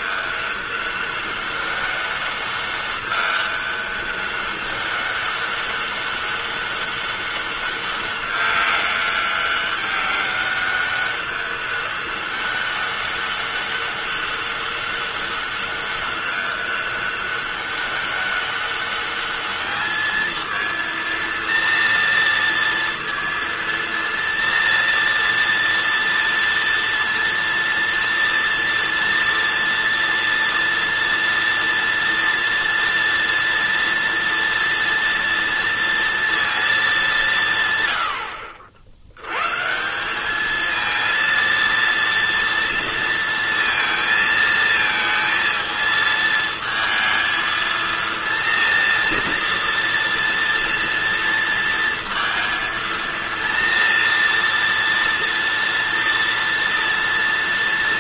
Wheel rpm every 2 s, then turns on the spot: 200, 200, 200, 200, 200, 200, 200, 200, 200, 200, 230, 230, 230, 230, 230, 230, 230, 240, 220, 60, 220, 230, 220, 220, 230, 230, 230, 230, 230.
none